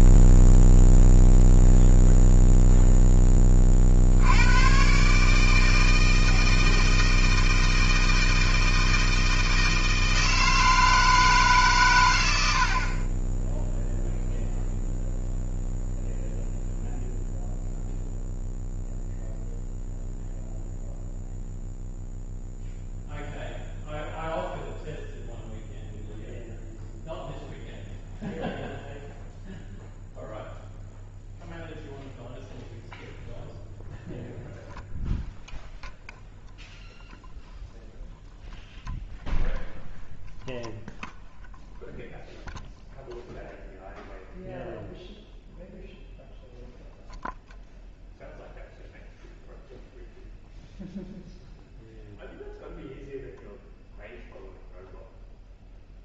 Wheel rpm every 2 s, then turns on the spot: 0, 0, 90, 160, 160, 160, 90, 0, 0, 0, 0, 0, 0, 0, 0, 0, 0, 0, 0, 0, 0, 0, 0, 0, 0, 0, 0, 0.
none